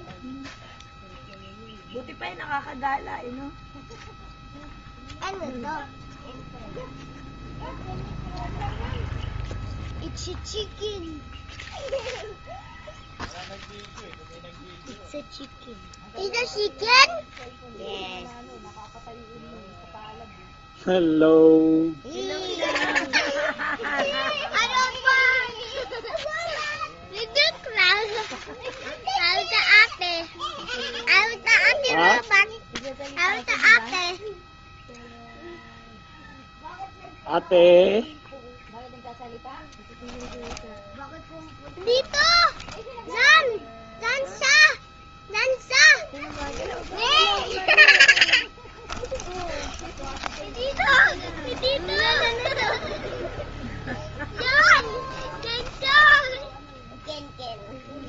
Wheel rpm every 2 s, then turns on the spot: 0, 0, 0, 0, 0, 0, 0, 0, 0, 0, 0, 0, 0, 0, 0, 0, 0, 0, 0, 0, 0, 0, 0, 10, 10, 20, 10, 10, 10.
46-48 50-52